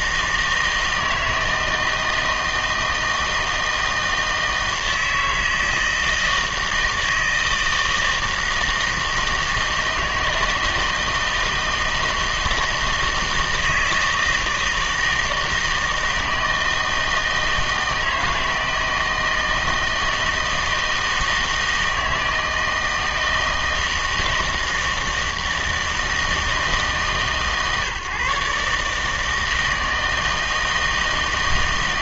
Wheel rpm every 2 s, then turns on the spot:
160, 160, 160, 160, 160, 160, 160, 160, 160, 160, 160, 160, 160, 160, 150, 160.
none